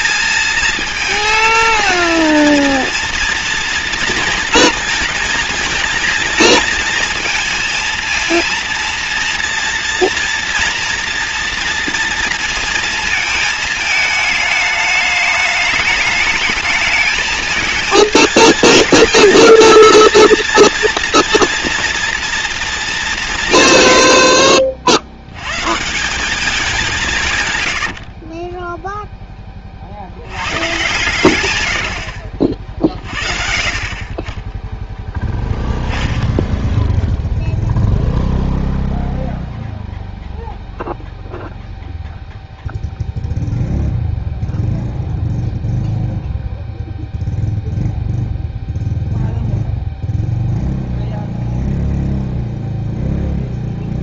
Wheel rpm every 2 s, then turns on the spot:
230, 230, 230, 230, 230, 230, 230, 210, 220, 220, 230, 220, 60, 180, 10, 120, 50, 0, 0, 0, 0, 0, 0, 0, 0, 0, 0.
28-30